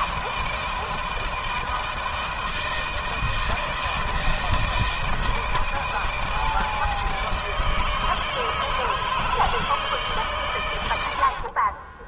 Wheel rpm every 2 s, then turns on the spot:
160, 160, 160, 160, 150, 130.
none